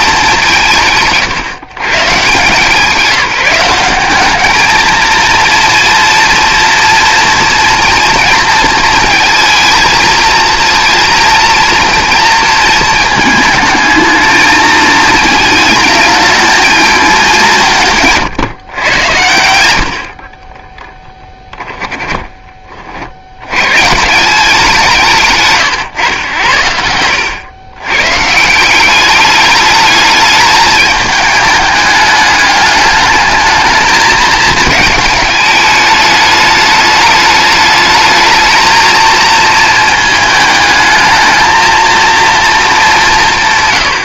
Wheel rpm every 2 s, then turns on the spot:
170, 170, 220, 230, 220, 230, 220, 220, 220, 130, 10, 50, 180, 90, 180, 210, 210, 210, 210, 220, 220, 200.
20-22